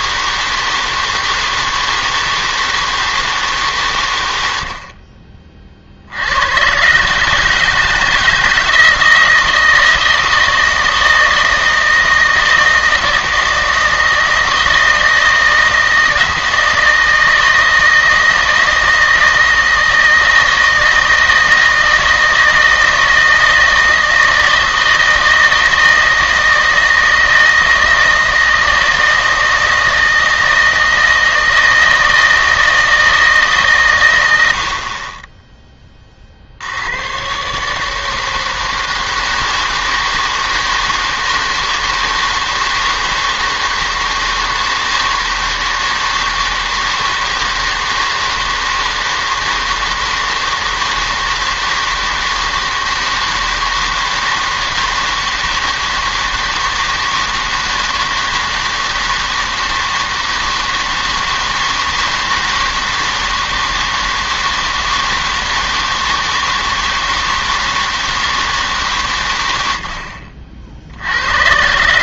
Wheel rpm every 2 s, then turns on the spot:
160, 160, 60, 120, 160, 160, 160, 160, 160, 160, 160, 160, 160, 160, 160, 160, 160, 60, 80, 160, 160, 160, 160, 160, 160, 160, 160, 160, 160, 160, 160, 160, 160, 160, 150, 60.
none